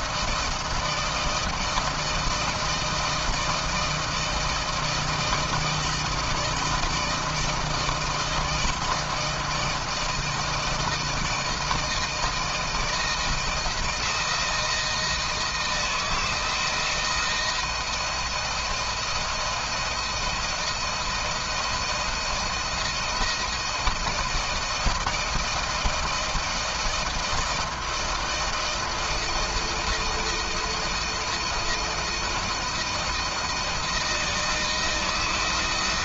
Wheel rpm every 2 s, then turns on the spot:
160, 160, 160, 160, 160, 160, 160, 160, 160, 160, 170, 160, 170, 160, 160, 170, 160, 160.
none